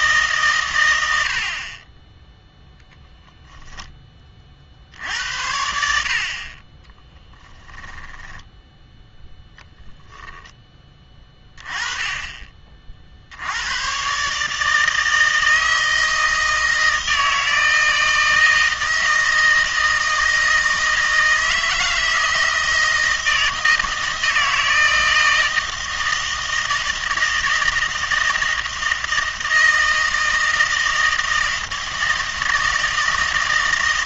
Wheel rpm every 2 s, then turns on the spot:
100, 0, 60, 20, 10, 10, 30, 160, 160, 160, 160, 160, 160, 160, 160, 160, 160.
none